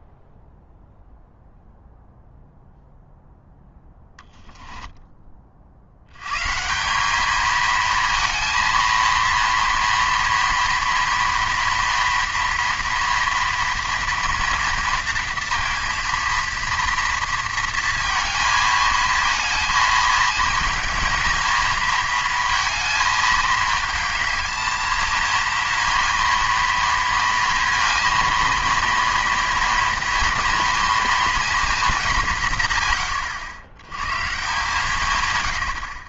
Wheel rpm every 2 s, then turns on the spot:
0, 0, 10, 170, 230, 230, 230, 230, 230, 220, 230, 220, 220, 230, 230, 230, 130, 150.
none